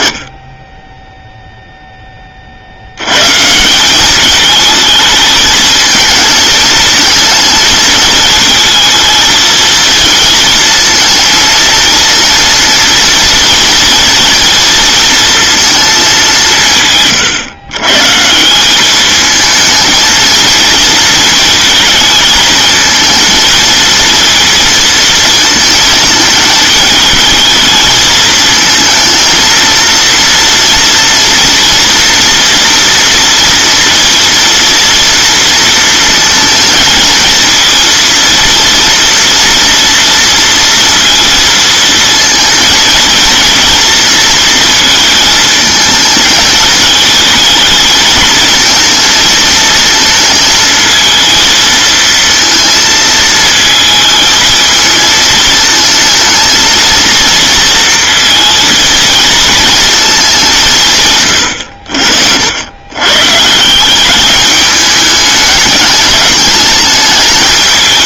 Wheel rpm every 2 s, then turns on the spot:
30, 50, 210, 220, 220, 230, 230, 230, 180, 180, 220, 220, 230, 210, 220, 230, 230, 230, 220, 230, 230, 220, 220, 220, 230, 230, 230, 220, 230, 230, 170, 100, 210, 220.
none